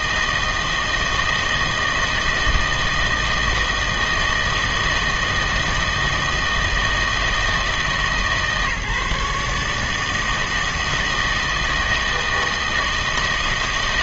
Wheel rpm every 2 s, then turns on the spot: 160, 160, 160, 160, 150, 160, 160.
none